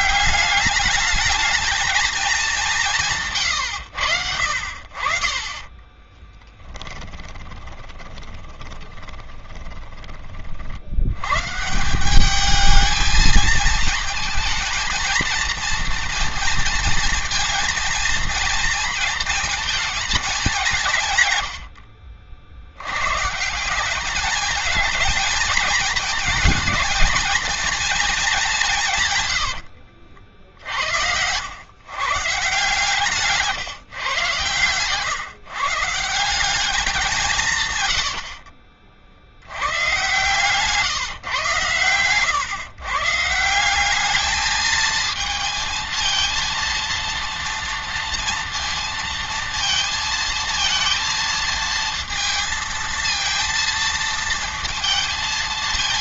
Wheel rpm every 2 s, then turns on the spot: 200, 190, 60, 20, 20, 50, 220, 230, 230, 230, 180, 80, 220, 220, 170, 70, 140, 130, 190, 50, 140, 130, 220, 230, 230, 230, 230, 230.
4-10